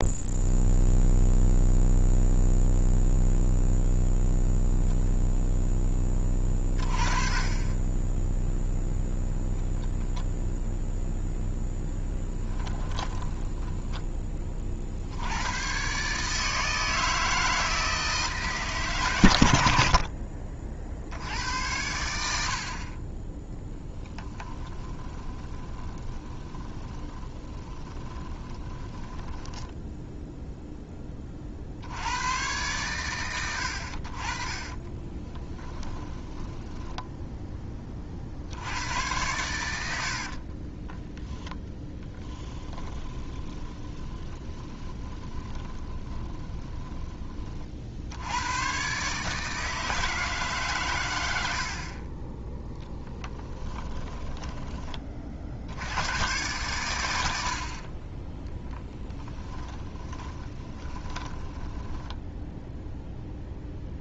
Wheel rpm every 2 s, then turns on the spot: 0, 0, 0, 20, 0, 0, 10, 50, 160, 140, 50, 40, 20, 10, 20, 10, 120, 30, 10, 90, 30, 10, 20, 10, 130, 150, 10, 20, 100, 10, 20, 0.
12-14 24-30 34-38 40-48 60-62